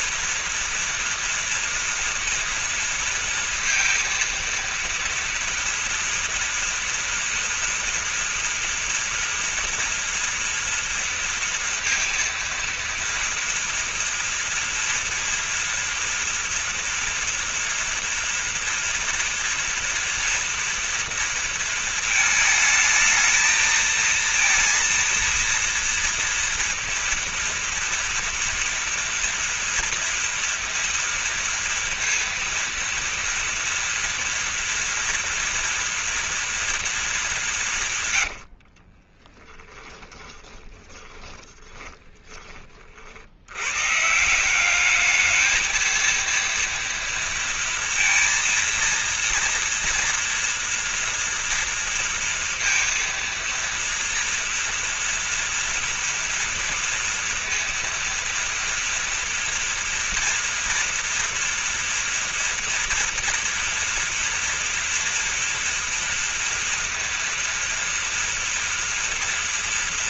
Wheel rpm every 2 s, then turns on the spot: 230, 230, 230, 230, 240, 230, 230, 230, 240, 230, 230, 220, 230, 230, 230, 230, 230, 230, 220, 50, 10, 50, 200, 230, 230, 230, 230, 230, 230, 230, 240, 230, 230, 230, 230.
38-42